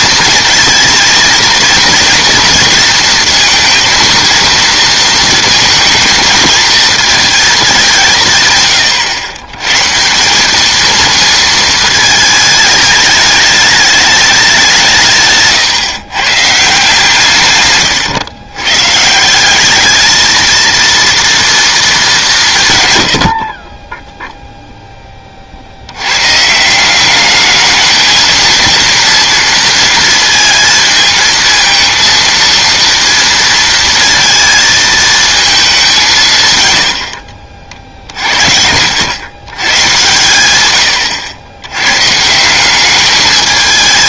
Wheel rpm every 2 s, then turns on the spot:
230, 230, 230, 220, 130, 200, 220, 190, 140, 120, 230, 150, 0, 160, 230, 220, 230, 230, 130, 60, 100, 180.
none